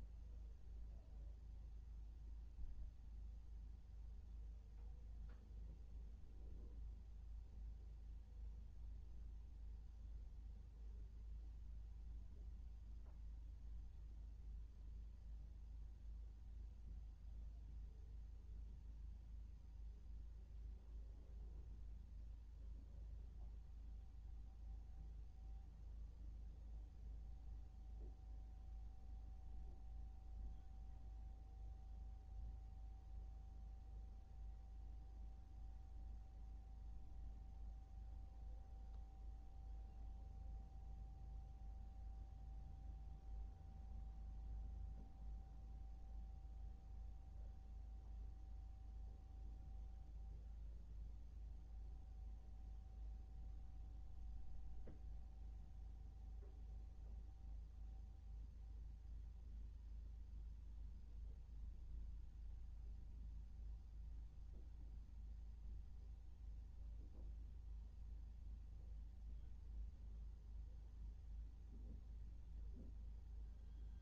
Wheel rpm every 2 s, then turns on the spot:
0, 0, 0, 0, 0, 0, 0, 0, 0, 0, 0, 0, 0, 0, 0, 0, 0, 0, 0, 0, 0, 0, 0, 0, 0, 0, 0, 0, 0, 0, 0, 0, 0, 0, 0, 0, 0.
none